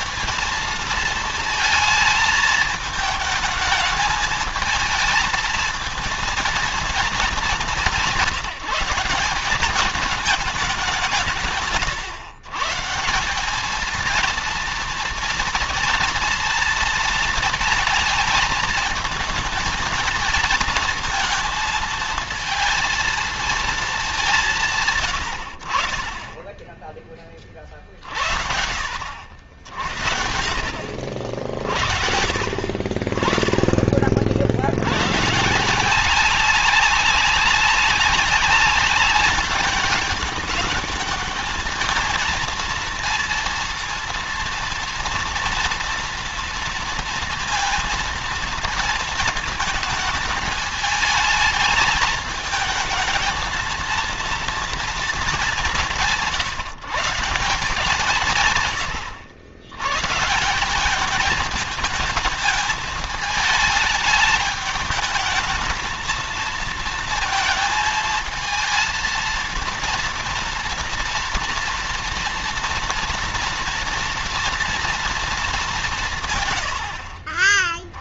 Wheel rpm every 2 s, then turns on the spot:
230, 220, 220, 230, 180, 180, 150, 230, 230, 220, 220, 230, 150, 30, 60, 60, 40, 100, 190, 200, 210, 230, 230, 230, 220, 220, 220, 230, 170, 110, 190, 220, 210, 230, 220, 230, 230, 230, 80.
none